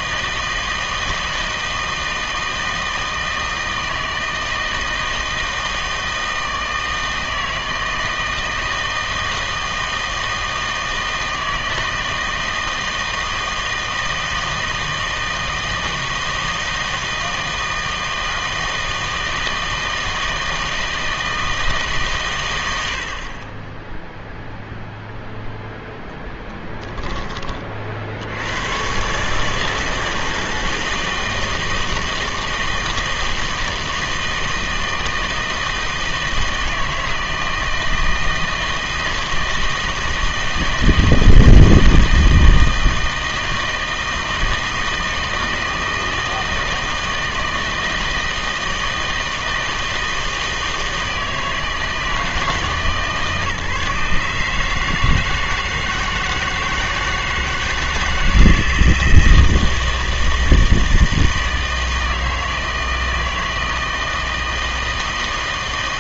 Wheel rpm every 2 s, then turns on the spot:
160, 160, 160, 160, 160, 160, 160, 160, 160, 160, 160, 90, 0, 10, 110, 160, 160, 160, 160, 170, 160, 160, 160, 160, 160, 160, 160, 150, 160, 160, 160, 160, 160.
26-28